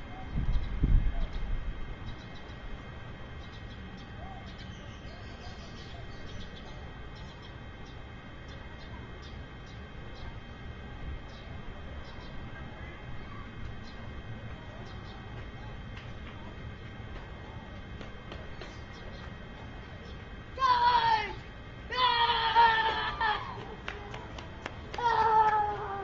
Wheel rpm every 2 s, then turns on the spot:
0, 0, 0, 0, 0, 0, 0, 0, 0, 0, 0, 0, 0.
none